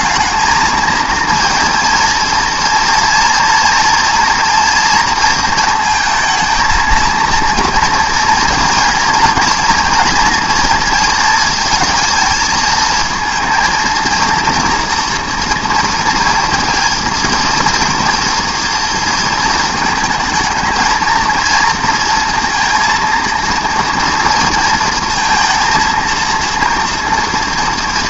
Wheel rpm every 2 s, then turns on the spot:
220, 230, 230, 220, 230, 230, 220, 230, 230, 230, 220, 230, 230, 230.
none